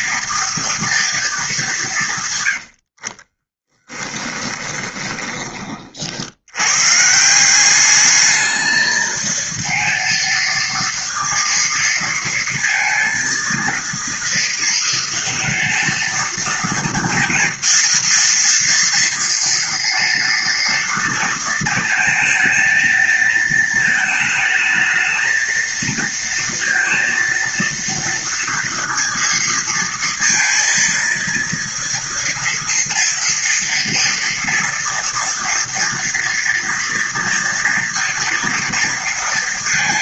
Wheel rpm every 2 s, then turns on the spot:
230, 130, 10, 80, 220, 230, 230, 230, 230, 230, 230, 220, 220, 230, 230, 230, 240, 230, 230, 230.
4-6